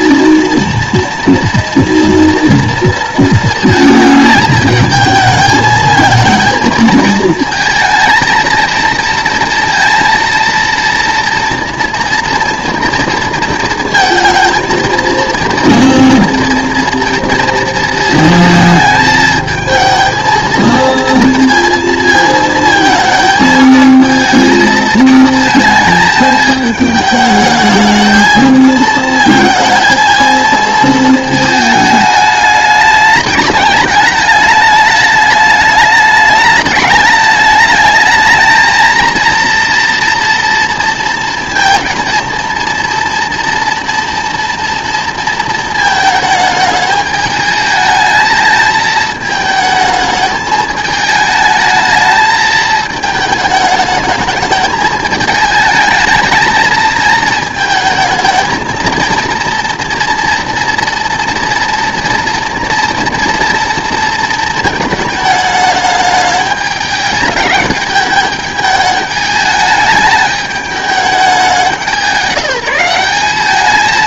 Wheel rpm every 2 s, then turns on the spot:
230, 230, 220, 220, 220, 230, 230, 220, 230, 220, 230, 220, 220, 210, 220, 220, 210, 210, 210, 220, 230, 230, 230, 210, 220, 220, 220, 210, 220, 220, 240, 240, 220, 210, 210, 210, 180.
none